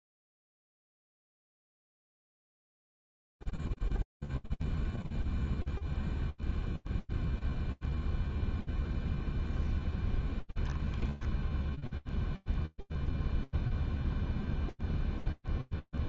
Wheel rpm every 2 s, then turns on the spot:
0, 0, 0, 0, 0, 0, 0, 0.
none